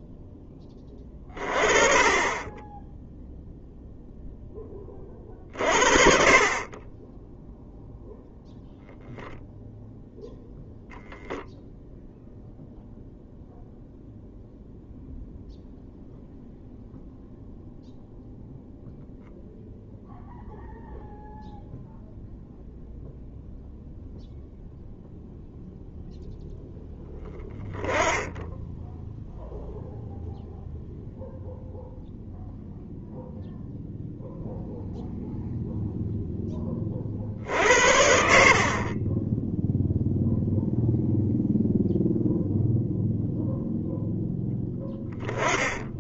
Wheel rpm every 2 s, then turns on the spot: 10, 20, 20, 40, 0, 0, 0, 0, 0, 0, 0, 0, 0, 0, 0, 0, 0, 0, 20, 50, 0, 0, 10.
6-8